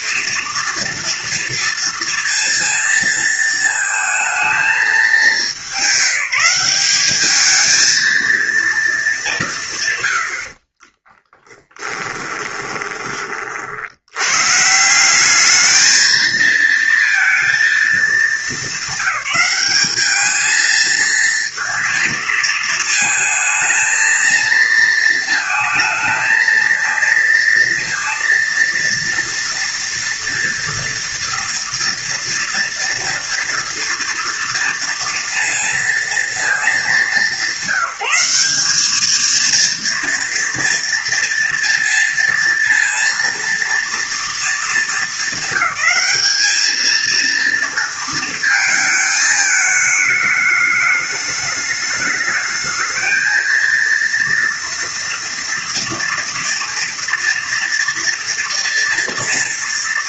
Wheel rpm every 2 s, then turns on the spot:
230, 230, 220, 190, 220, 40, 20, 150, 230, 200, 220, 220, 230, 220, 230, 230, 230, 230, 220, 200, 230, 230, 220, 220, 220, 210, 220, 230, 240, 230.
10-14